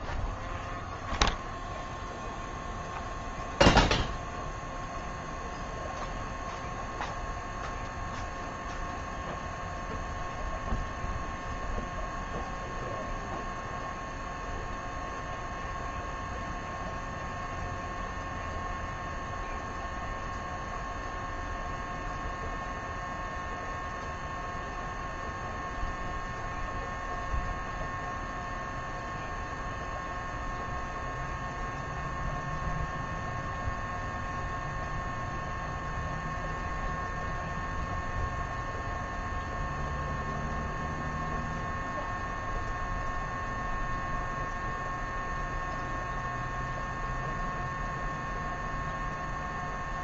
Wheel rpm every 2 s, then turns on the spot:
0, 0, 0, 0, 0, 0, 0, 0, 0, 0, 0, 0, 0, 0, 0, 0, 0, 0, 0, 0, 0, 0, 0, 0, 0.
none